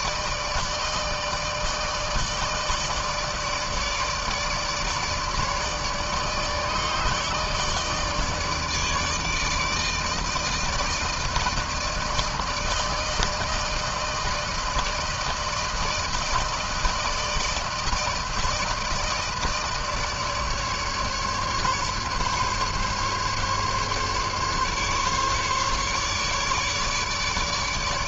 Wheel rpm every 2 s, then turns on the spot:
160, 150, 150, 150, 150, 160, 160, 160, 160, 150, 150, 140, 140, 150.
none